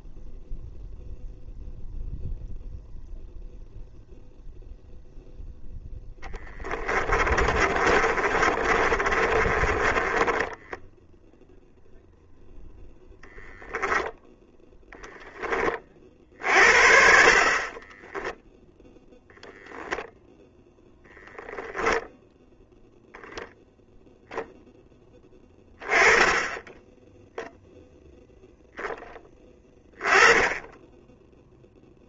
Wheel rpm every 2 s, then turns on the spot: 0, 0, 0, 20, 30, 0, 10, 10, 50, 0, 10, 0, 10, 10, 10, 10.
6-10 12-14 20-22